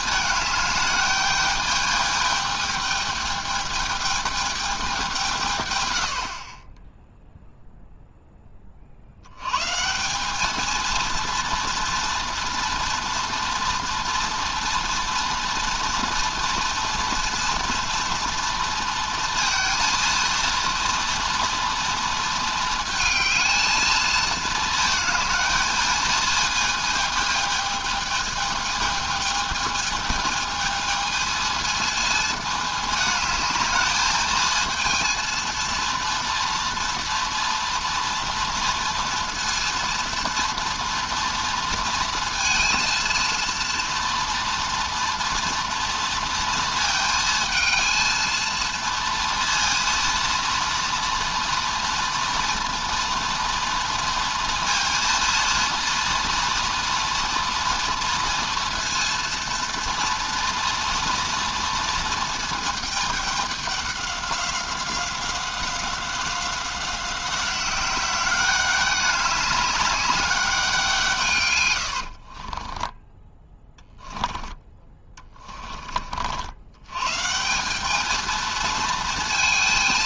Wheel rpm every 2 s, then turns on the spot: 210, 210, 200, 20, 40, 220, 230, 230, 240, 230, 230, 220, 220, 220, 220, 220, 220, 230, 230, 230, 240, 230, 230, 230, 230, 230, 230, 230, 240, 230, 230, 220, 190, 190, 200, 180, 20, 20, 100, 230.
72-76